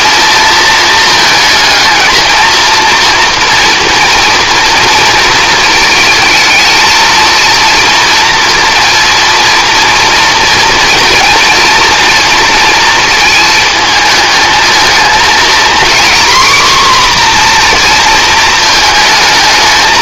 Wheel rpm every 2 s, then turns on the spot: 220, 230, 230, 230, 240, 230, 230, 220, 250, 220.
none